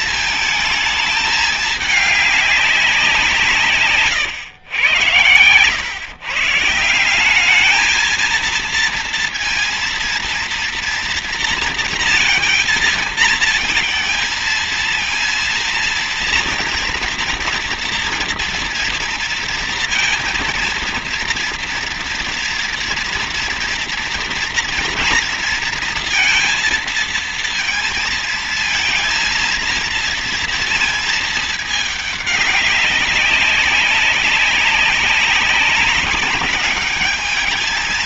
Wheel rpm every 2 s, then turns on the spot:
220, 180, 110, 170, 230, 230, 230, 230, 230, 230, 230, 230, 230, 230, 230, 220, 200, 200, 210.
none